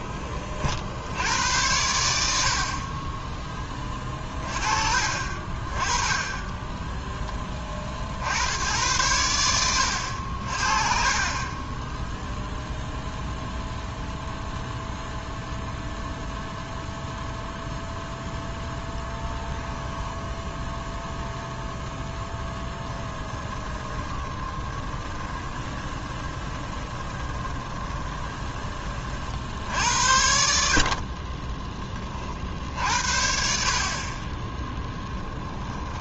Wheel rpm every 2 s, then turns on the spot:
40, 50, 40, 10, 80, 50, 0, 0, 0, 10, 0, 10, 20, 20, 30, 60, 60, 10.
6-8 10-12 18-20 22-28 30-32